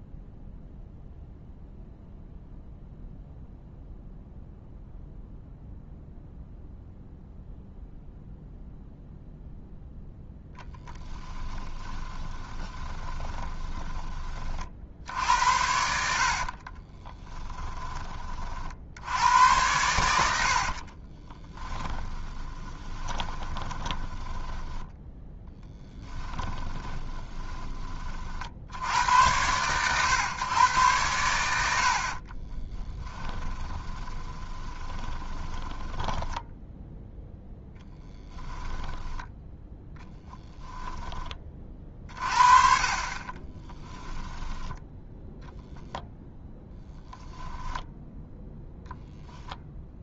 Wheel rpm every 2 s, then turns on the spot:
0, 0, 0, 0, 0, 10, 20, 60, 30, 60, 50, 20, 10, 10, 80, 110, 20, 20, 10, 10, 10, 40, 10, 0, 0.
12-14 16-18 20-28 32-42